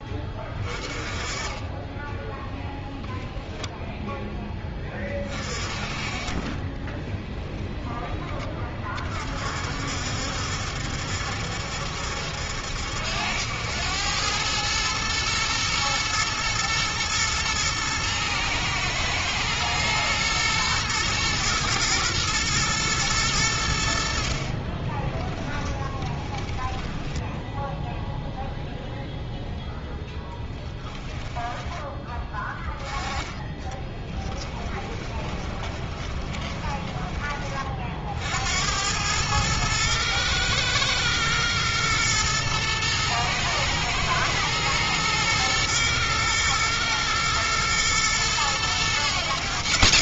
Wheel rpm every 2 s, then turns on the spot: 20, 0, 10, 20, 30, 70, 70, 110, 110, 110, 110, 120, 40, 10, 0, 10, 20, 20, 20, 80, 110, 110, 110, 110, 110.
24-28 34-38